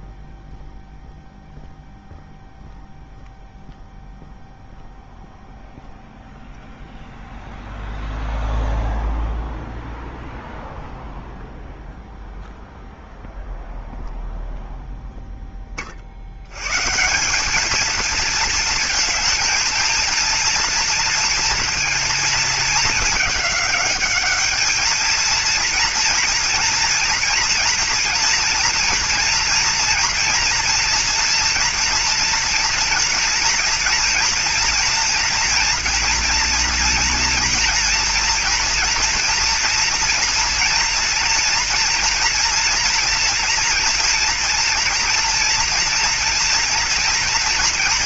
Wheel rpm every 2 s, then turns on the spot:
0, 0, 0, 0, 0, 0, 0, 0, 140, 220, 230, 220, 220, 240, 230, 230, 240, 230, 230, 230, 230, 230, 230, 230.
none